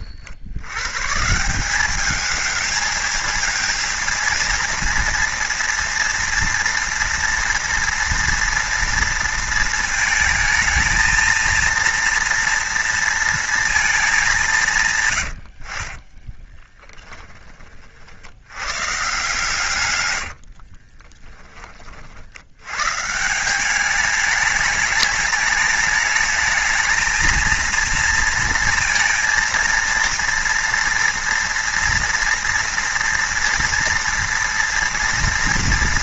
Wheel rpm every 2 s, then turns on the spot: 90, 220, 230, 230, 230, 220, 230, 190, 20, 110, 80, 90, 200, 220, 230, 230, 230, 230.
16-18 20-22